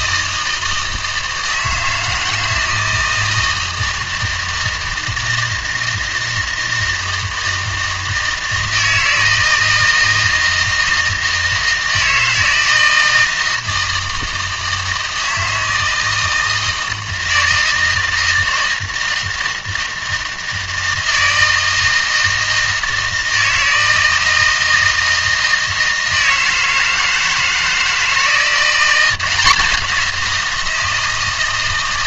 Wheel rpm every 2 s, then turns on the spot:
160, 160, 160, 160, 160, 160, 160, 160, 160, 160, 160, 160, 160, 160, 170, 170.
none